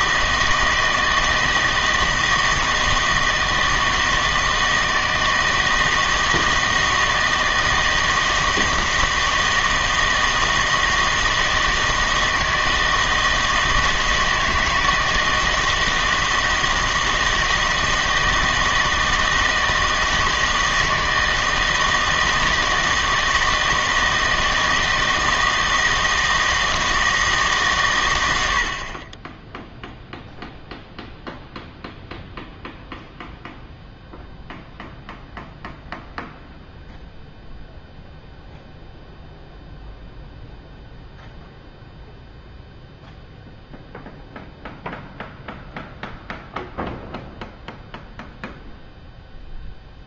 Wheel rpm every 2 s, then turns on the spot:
160, 160, 160, 160, 160, 160, 160, 160, 160, 160, 160, 160, 160, 160, 70, 0, 0, 0, 0, 0, 0, 0, 0, 0, 0.
none